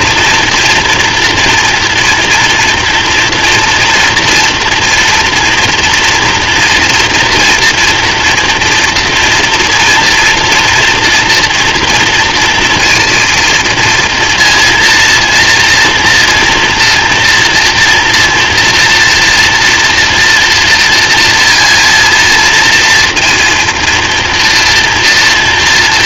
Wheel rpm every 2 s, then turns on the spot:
230, 230, 240, 230, 230, 230, 230, 230, 230, 240, 230, 230, 230.
none